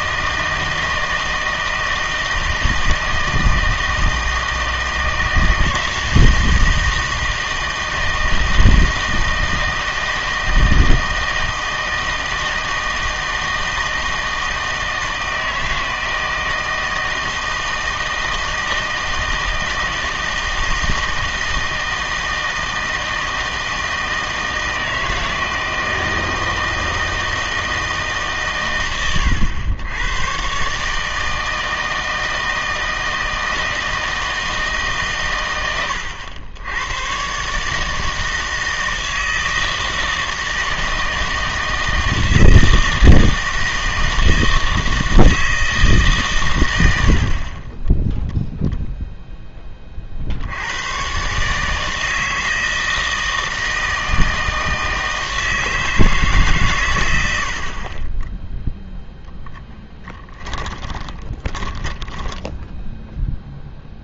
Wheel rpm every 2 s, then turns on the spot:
160, 160, 160, 160, 160, 160, 160, 160, 160, 160, 160, 160, 160, 160, 130, 140, 160, 150, 110, 160, 160, 160, 160, 100, 0, 90, 160, 160, 140, 0, 20, 0.
60-62